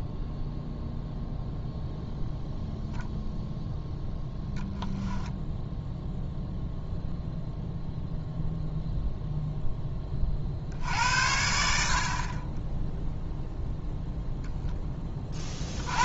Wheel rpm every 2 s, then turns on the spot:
0, 0, 0, 0, 0, 60, 10, 10.
none